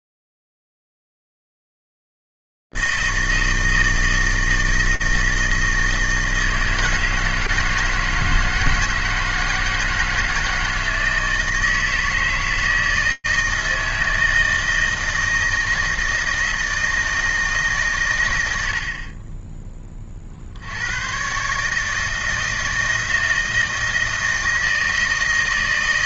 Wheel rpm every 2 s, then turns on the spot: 80, 160, 160, 160, 160, 160, 160, 160, 160, 130, 30, 160, 160.
none